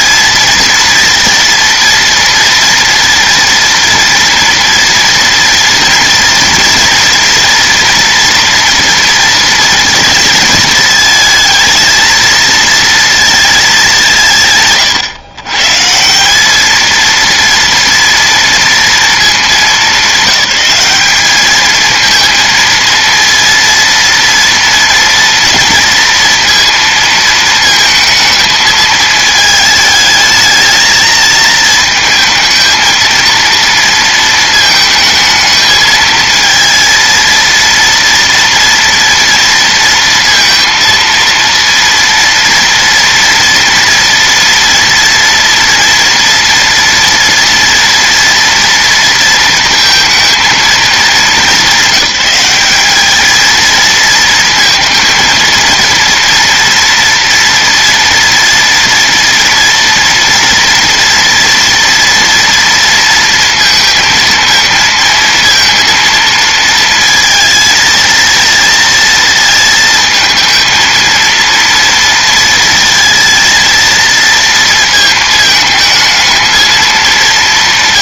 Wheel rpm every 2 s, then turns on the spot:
230, 230, 230, 240, 240, 230, 230, 130, 220, 230, 200, 220, 230, 230, 220, 220, 220, 220, 230, 230, 230, 230, 240, 230, 230, 210, 200, 230, 230, 230, 230, 230, 230, 230, 230, 230, 230, 230, 220.
none